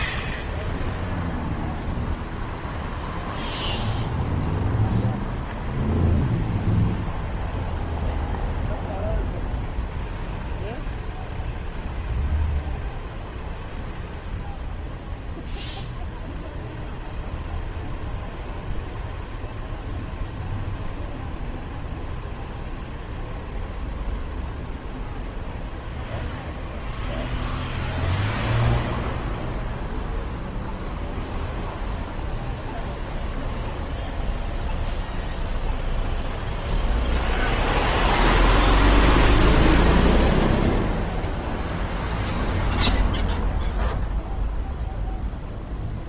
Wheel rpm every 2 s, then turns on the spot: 0, 0, 0, 0, 0, 0, 0, 0, 0, 0, 0, 0, 0, 0, 0, 0, 0, 0, 0, 0, 0, 0, 0.
none